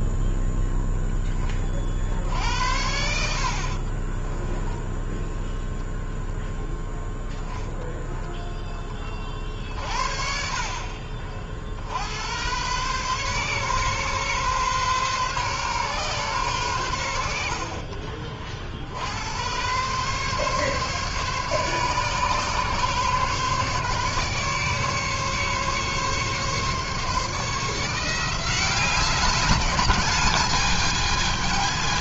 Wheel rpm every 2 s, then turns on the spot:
10, 70, 10, 0, 10, 50, 120, 130, 110, 60, 140, 140, 140, 150, 180, 210.
2-4